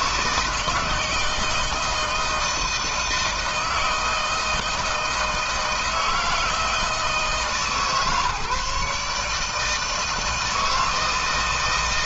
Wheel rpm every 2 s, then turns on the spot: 160, 160, 160, 160, 150, 160.
none